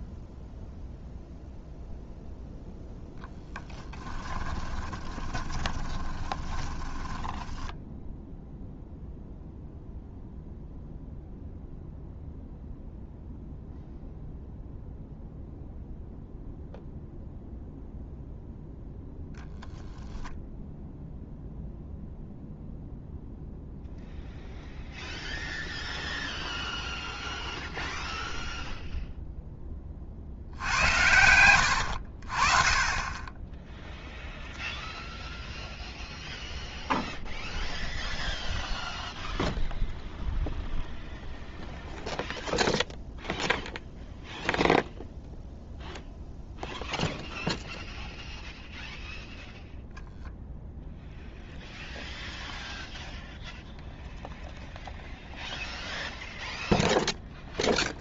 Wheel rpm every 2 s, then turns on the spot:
0, 0, 20, 20, 0, 0, 0, 0, 0, 0, 0, 0, 0, 0, 0, 80, 30, 0, 0, 0, 0, 0, 0, 0, 0, 0, 0, 0, 0.
4-8 30-32